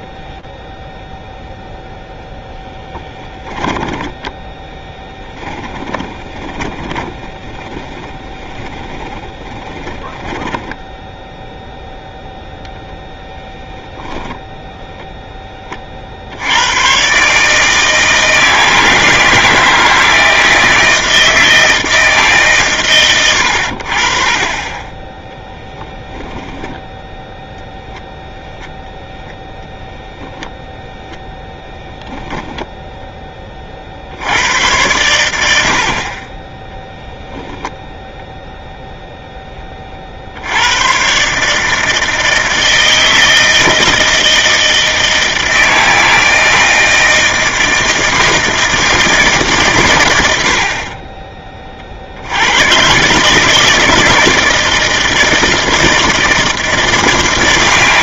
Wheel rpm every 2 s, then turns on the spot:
0, 10, 10, 20, 40, 0, 0, 0, 130, 160, 160, 110, 20, 0, 0, 0, 10, 110, 0, 0, 120, 160, 160, 160, 150, 30, 130, 160, 130.
2-10 24-26